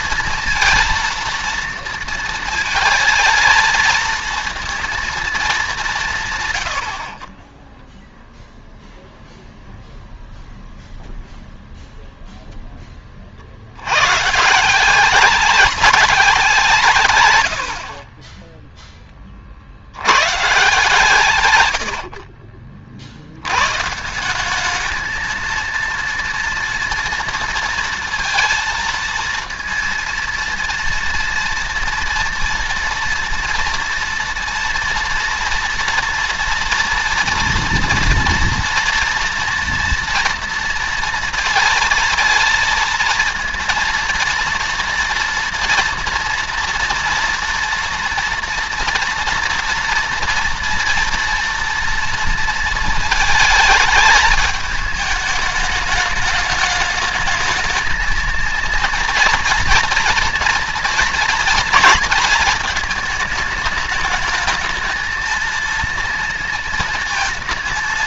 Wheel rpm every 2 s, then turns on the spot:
230, 230, 230, 90, 0, 0, 20, 170, 160, 10, 140, 50, 210, 230, 230, 230, 230, 230, 230, 230, 230, 230, 230, 230, 230, 230, 230, 210, 210, 230, 230, 220, 220, 230.
none